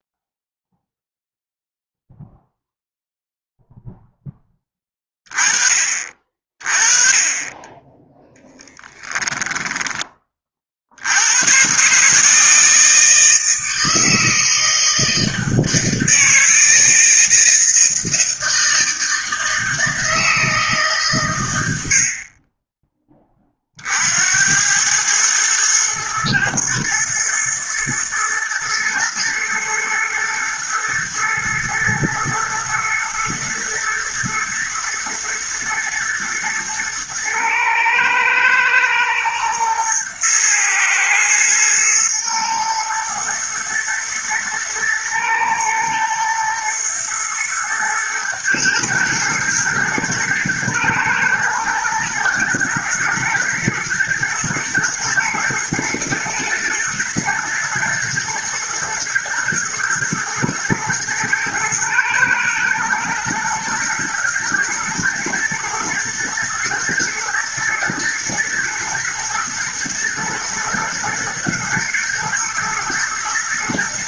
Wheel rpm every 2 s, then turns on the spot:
0, 0, 20, 30, 10, 80, 160, 160, 160, 160, 140, 20, 110, 120, 120, 110, 110, 120, 110, 120, 110, 110, 110, 120, 120, 110, 110, 110, 110, 120, 120, 120, 120, 120, 110, 110, 110.
8-10